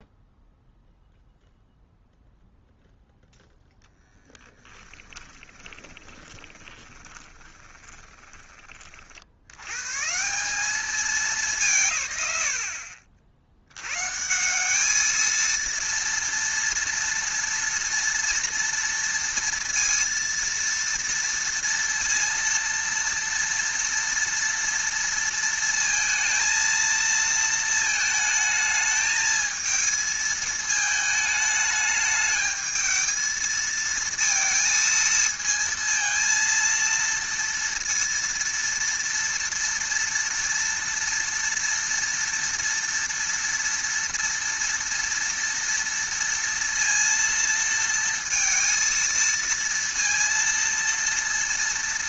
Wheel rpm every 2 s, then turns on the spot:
0, 0, 10, 20, 20, 170, 110, 180, 230, 230, 230, 230, 230, 230, 220, 220, 220, 230, 230, 230, 230, 230, 230, 230, 230, 230.
4-8